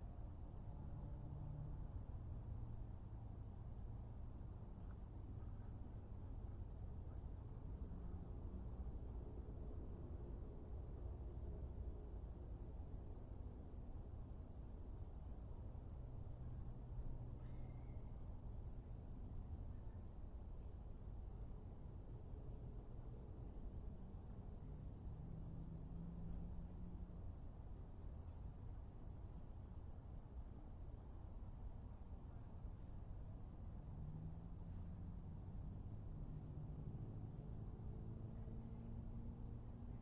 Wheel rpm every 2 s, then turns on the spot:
0, 0, 0, 0, 0, 0, 0, 0, 0, 0, 0, 0, 0, 0, 0, 0, 0, 0, 0, 0.
none